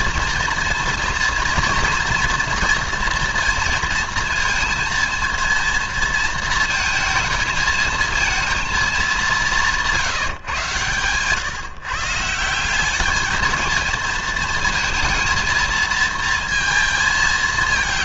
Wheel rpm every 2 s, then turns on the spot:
230, 230, 230, 230, 220, 120, 190, 230, 230.
none